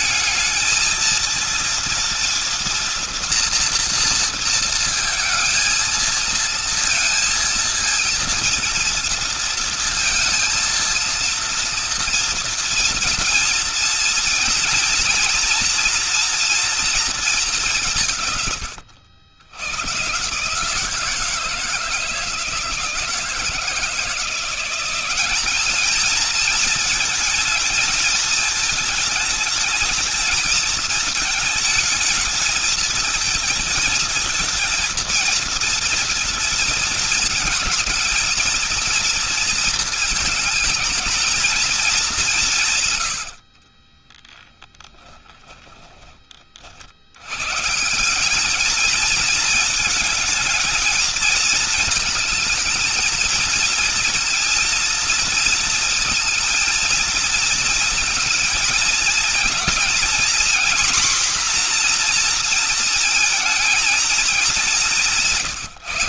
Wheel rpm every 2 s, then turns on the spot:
210, 240, 230, 230, 230, 230, 230, 230, 230, 150, 140, 160, 170, 210, 220, 220, 220, 230, 230, 220, 230, 190, 20, 30, 190, 220, 220, 230, 230, 220, 240, 240, 210.
44-46